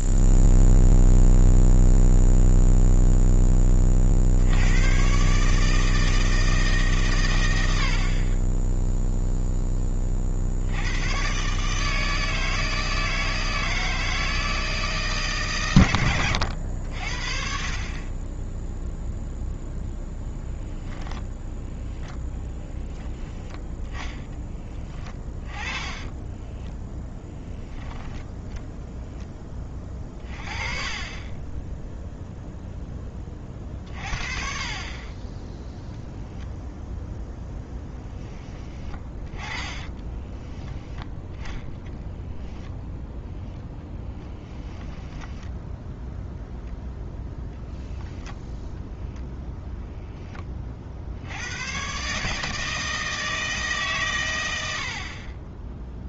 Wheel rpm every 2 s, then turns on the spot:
0, 0, 90, 160, 10, 80, 160, 160, 90, 10, 10, 0, 20, 10, 10, 20, 0, 40, 0, 20, 10, 0, 10, 0, 0, 30, 160, 90.
24-28 40-42 44-46